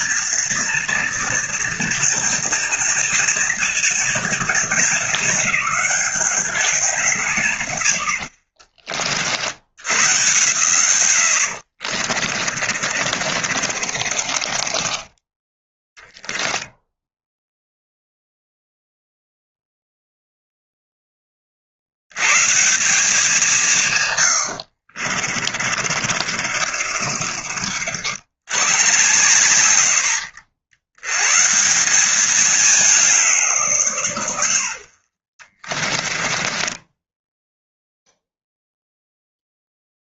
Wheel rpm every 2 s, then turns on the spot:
230, 230, 220, 190, 50, 130, 40, 30, 0, 0, 0, 170, 60, 50, 120, 100, 190, 60, 20, 0.
12-16 24-28 34-38